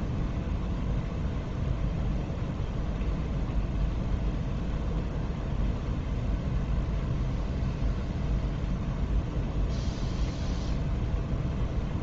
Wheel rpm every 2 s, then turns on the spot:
0, 0, 0, 0, 0, 0.
none